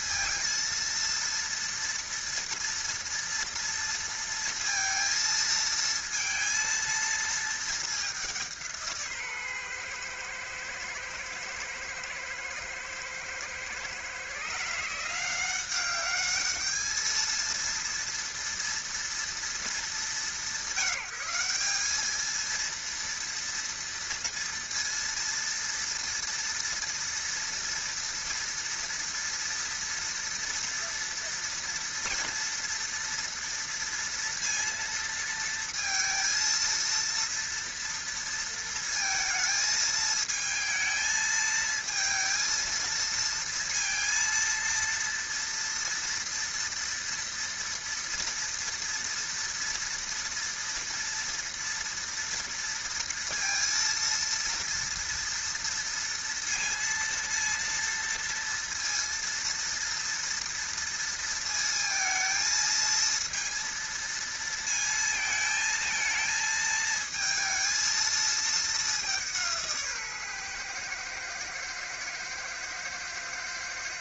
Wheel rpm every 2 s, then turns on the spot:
230, 230, 230, 230, 180, 120, 110, 140, 210, 230, 170, 220, 230, 230, 230, 230, 230, 230, 230, 230, 220, 230, 230, 230, 230, 230, 230, 230, 230, 230, 230, 220, 230, 220, 220, 130, 110.
none